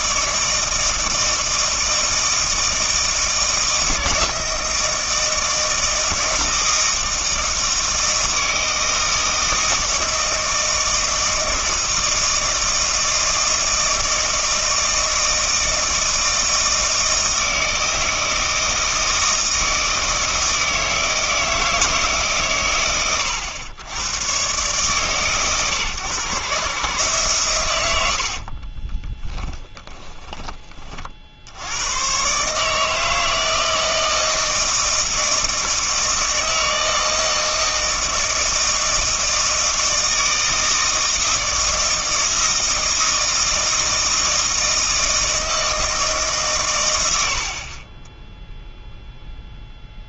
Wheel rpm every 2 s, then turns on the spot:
160, 160, 160, 160, 160, 160, 160, 160, 160, 160, 160, 110, 140, 140, 30, 30, 150, 160, 160, 160, 160, 160, 160, 120, 0.
28-30